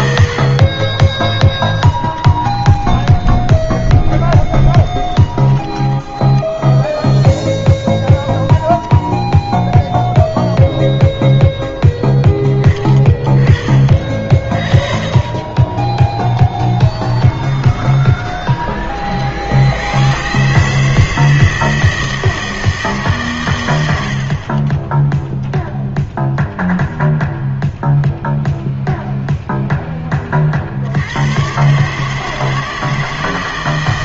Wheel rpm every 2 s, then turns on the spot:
50, 10, 10, 0, 0, 0, 20, 40, 10, 30, 150, 160, 30, 0, 0, 60, 160.
2-6 16-18